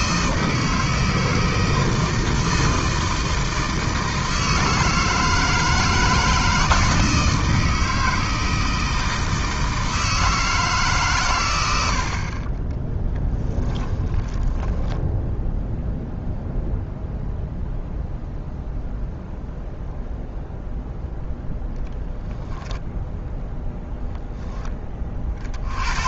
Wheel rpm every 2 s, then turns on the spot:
160, 160, 160, 160, 160, 150, 20, 10, 0, 0, 0, 10, 20.
12-16